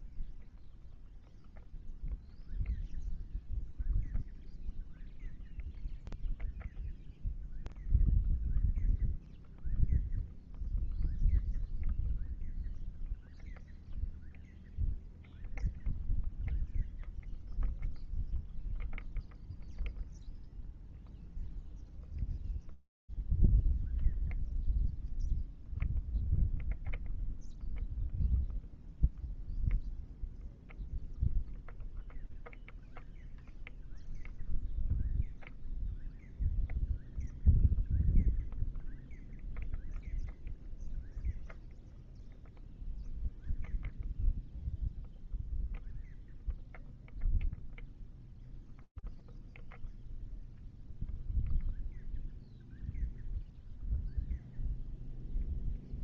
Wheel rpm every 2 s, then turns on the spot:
0, 0, 0, 0, 0, 0, 0, 0, 0, 0, 0, 0, 0, 0, 0, 0, 0, 0, 0, 0, 0, 0, 0, 0, 0, 0, 0, 0.
none